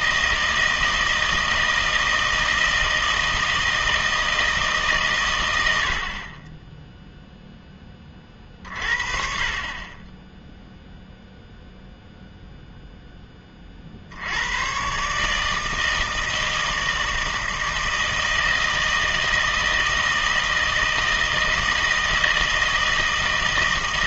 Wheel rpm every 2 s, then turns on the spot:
160, 160, 150, 20, 40, 0, 0, 100, 160, 160, 160, 160.
none